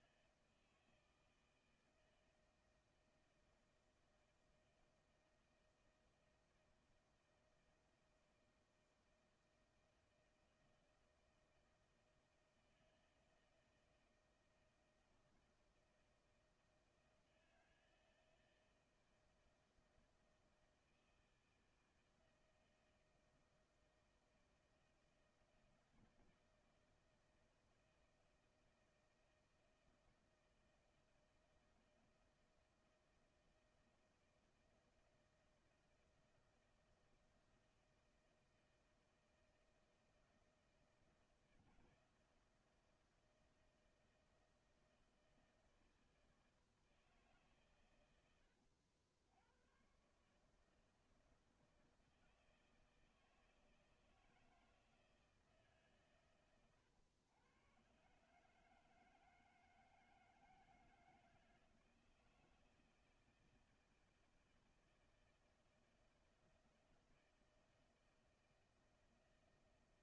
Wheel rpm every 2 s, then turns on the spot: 160, 160, 160, 160, 160, 160, 160, 160, 160, 160, 160, 160, 160, 160, 160, 160, 160, 160, 160, 160, 160, 160, 160, 160, 100, 140, 160, 160, 120, 150, 160, 160, 160, 160, 160.
none